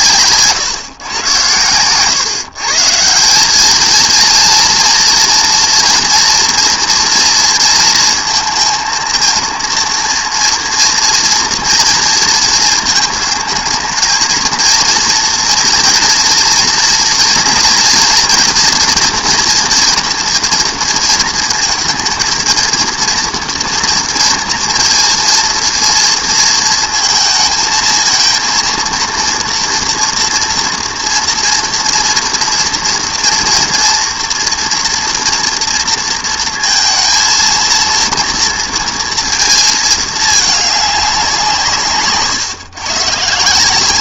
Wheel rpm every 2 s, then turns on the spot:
130, 150, 230, 230, 230, 230, 220, 230, 230, 230, 230, 230, 230, 220, 230, 240, 230, 230, 230, 230, 210, 130.
none